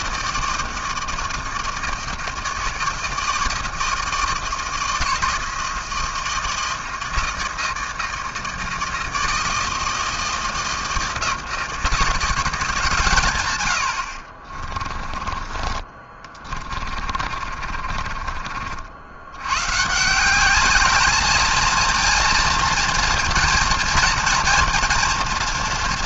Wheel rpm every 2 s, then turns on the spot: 160, 160, 160, 170, 160, 160, 170, 40, 30, 50, 180, 230, 230.
14-20